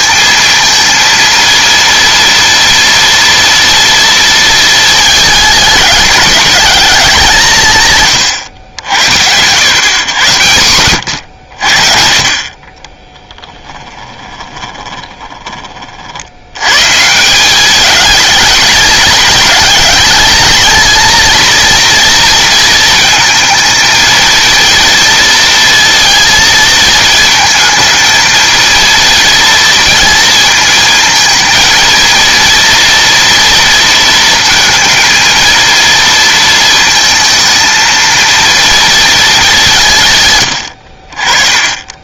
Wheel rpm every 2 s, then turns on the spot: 220, 230, 220, 210, 100, 100, 30, 20, 110, 210, 220, 230, 230, 230, 230, 220, 230, 230, 230, 230, 90.
14-16